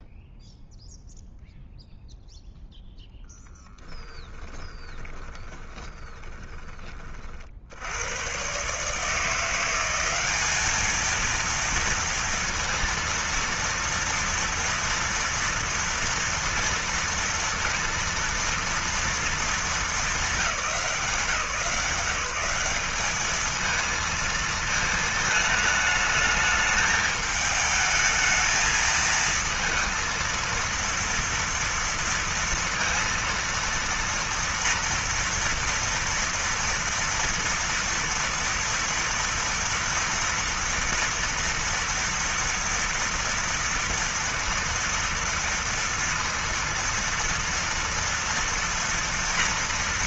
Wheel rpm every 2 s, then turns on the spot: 0, 0, 20, 20, 130, 210, 230, 230, 230, 230, 200, 200, 220, 220, 220, 230, 230, 240, 230, 230, 230, 230, 230, 230, 230.
4-6